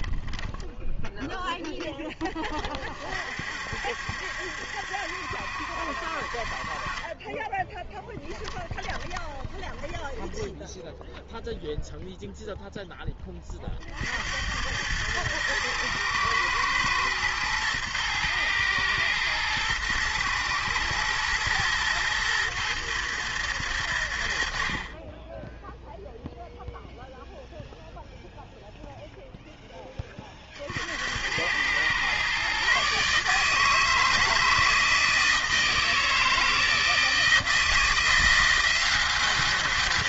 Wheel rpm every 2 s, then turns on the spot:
20, 30, 70, 40, 20, 10, 0, 100, 110, 110, 110, 120, 60, 0, 0, 50, 130, 160, 160, 180.
8-10